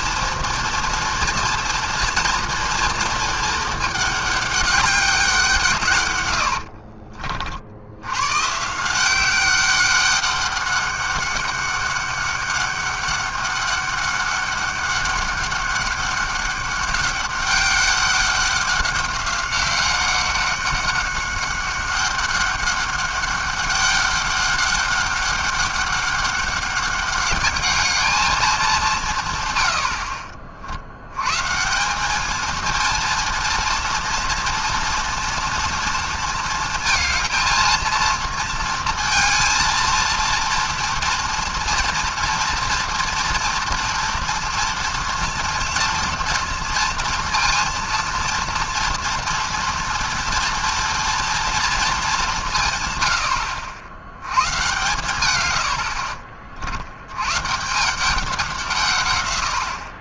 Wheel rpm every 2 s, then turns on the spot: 230, 230, 200, 80, 140, 200, 200, 200, 200, 200, 200, 200, 200, 200, 200, 50, 220, 230, 230, 230, 230, 230, 230, 230, 230, 230, 150, 110, 50, 170.
6-8